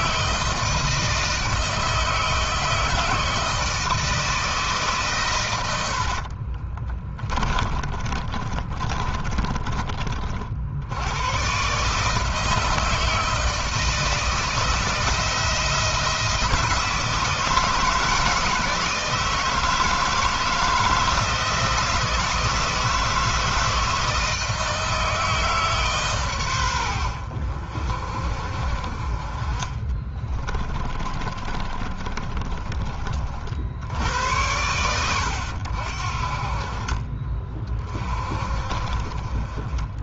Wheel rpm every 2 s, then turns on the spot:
160, 160, 130, 30, 20, 100, 160, 160, 160, 160, 160, 160, 160, 80, 50, 30, 40, 90, 40, 30.
6-10 28-32